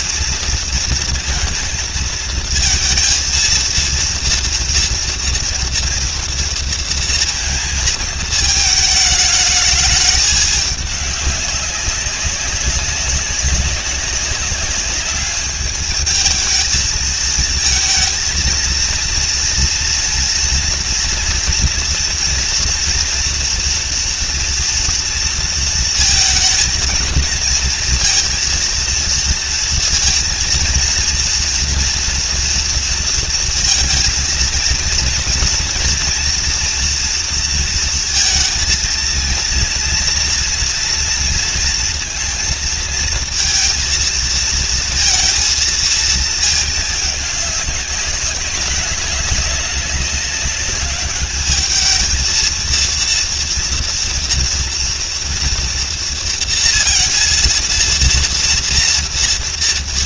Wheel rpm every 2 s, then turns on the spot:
230, 220, 230, 230, 220, 210, 190, 200, 220, 230, 230, 230, 230, 220, 230, 230, 230, 230, 230, 220, 240, 230, 230, 210, 210, 200, 230, 230, 230, 230.
none